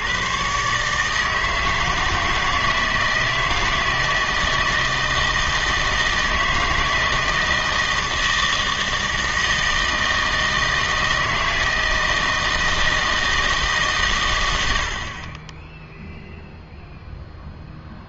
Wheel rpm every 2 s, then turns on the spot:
140, 160, 160, 160, 160, 160, 160, 80, 0.
none